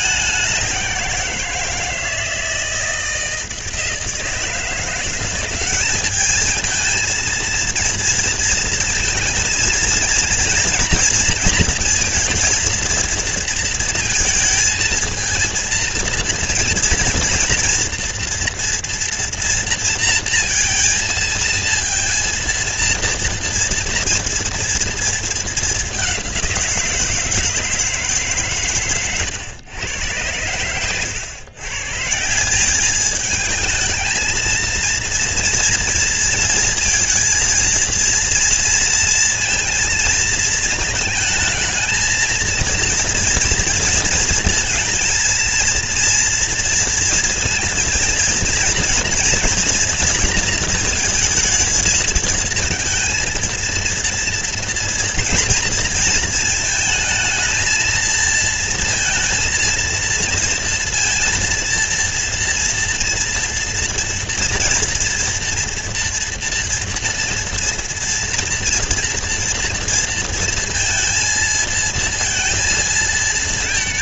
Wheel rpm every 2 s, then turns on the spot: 200, 160, 160, 210, 230, 230, 230, 230, 230, 230, 230, 230, 230, 190, 150, 100, 160, 220, 230, 230, 220, 220, 230, 240, 230, 230, 220, 230, 230, 230, 230, 230, 230, 240, 230, 230, 230.
none